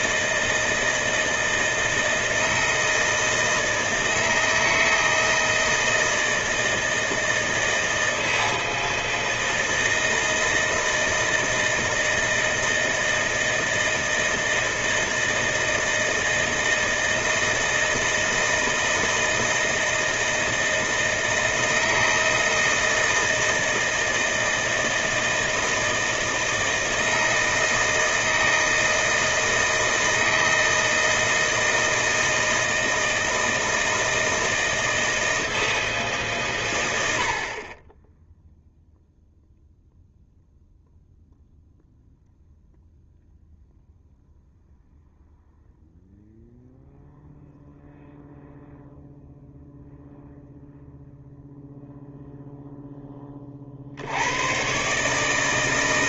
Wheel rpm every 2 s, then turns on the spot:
160, 160, 160, 160, 160, 160, 160, 160, 160, 160, 160, 160, 160, 160, 160, 160, 160, 160, 140, 0, 0, 0, 0, 0, 0, 0, 0, 110.
none